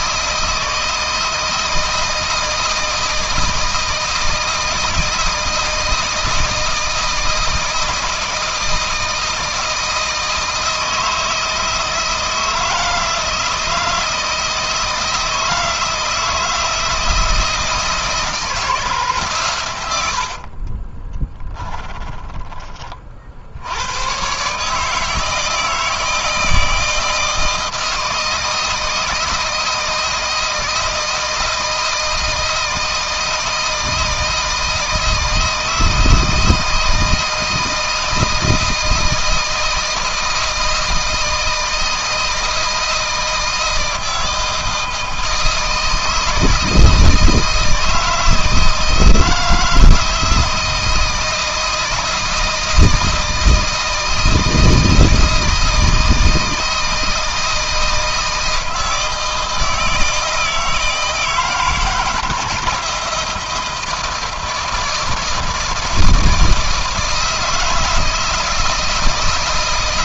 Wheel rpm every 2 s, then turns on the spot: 160, 160, 160, 160, 160, 160, 160, 160, 160, 150, 30, 30, 150, 160, 160, 160, 160, 160, 160, 160, 160, 160, 160, 160, 160, 160, 160, 160, 160, 160, 160, 160, 160, 160, 160.
20-22